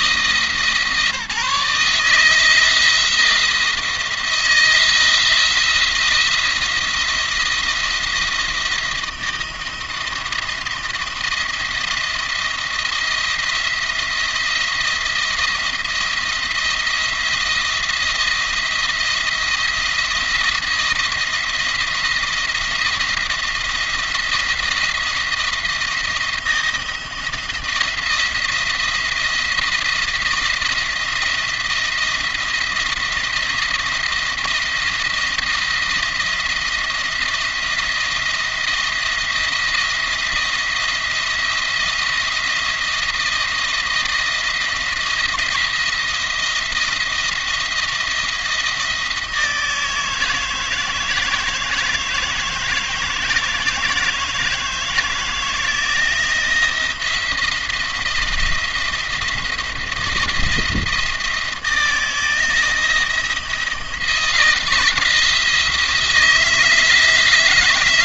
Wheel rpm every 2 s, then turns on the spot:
160, 160, 170, 170, 170, 170, 170, 170, 170, 170, 160, 170, 170, 170, 170, 170, 170, 170, 170, 170, 170, 170, 170, 170, 160, 160, 160, 160, 170, 170, 170, 170, 170, 160.
none